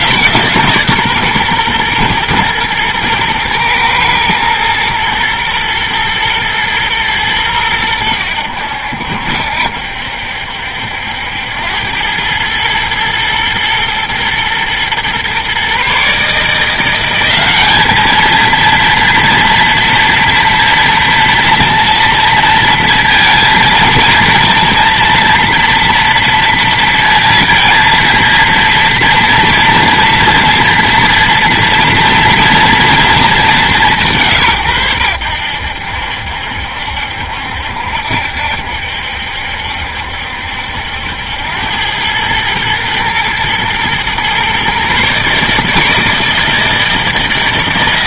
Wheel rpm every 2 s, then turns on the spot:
140, 120, 110, 120, 80, 70, 110, 120, 170, 230, 230, 230, 230, 230, 230, 240, 230, 110, 70, 70, 70, 110, 130, 160.
none